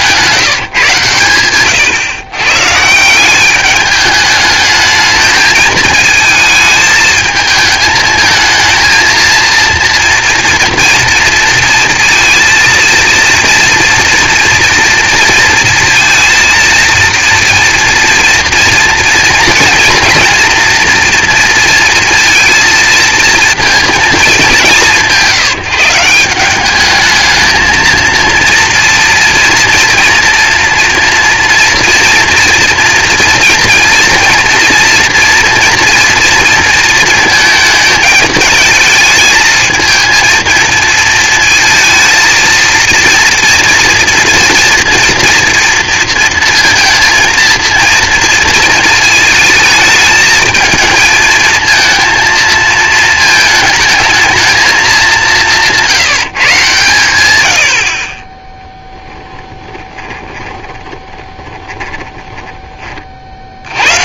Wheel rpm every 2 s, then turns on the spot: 140, 140, 210, 220, 220, 230, 230, 230, 230, 230, 230, 230, 190, 200, 230, 230, 230, 230, 230, 220, 220, 230, 230, 230, 230, 220, 220, 210, 140, 10, 20, 20.
58-62